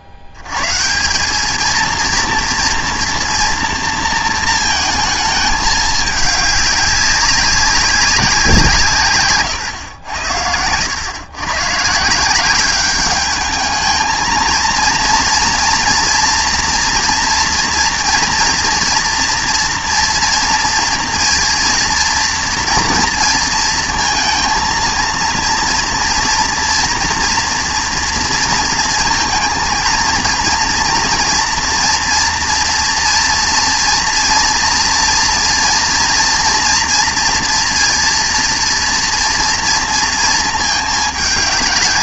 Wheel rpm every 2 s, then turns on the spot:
80, 230, 230, 210, 170, 90, 190, 230, 240, 230, 230, 230, 230, 230, 230, 230, 230, 230, 230, 230, 220.
none